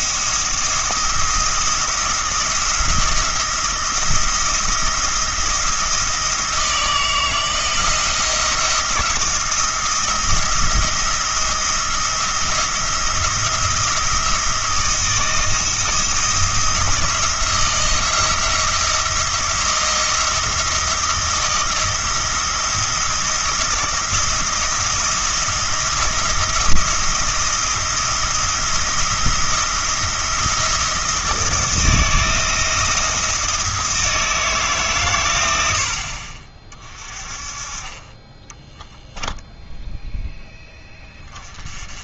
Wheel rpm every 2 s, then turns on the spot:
170, 170, 170, 160, 170, 170, 170, 170, 170, 170, 170, 170, 170, 170, 170, 170, 170, 140, 30, 10, 0.
38-40